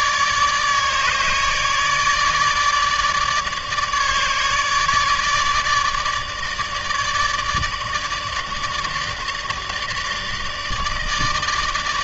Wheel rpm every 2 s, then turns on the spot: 150, 150, 150, 150, 150, 150.
none